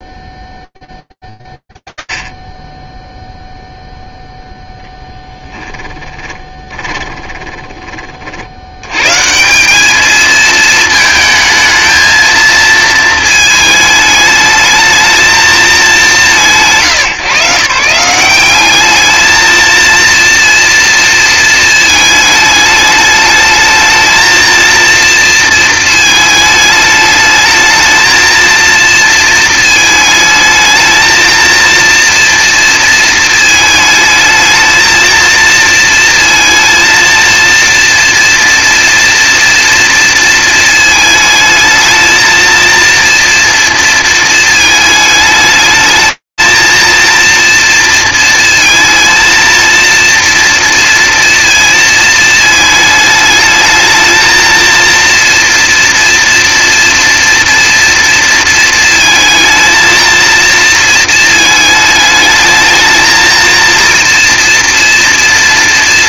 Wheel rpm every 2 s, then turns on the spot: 10, 10, 0, 20, 70, 220, 230, 220, 170, 180, 230, 210, 220, 220, 230, 220, 230, 220, 230, 230, 220, 230, 220, 230, 230, 230, 220, 230, 230, 230, 230, 220, 230.
6-8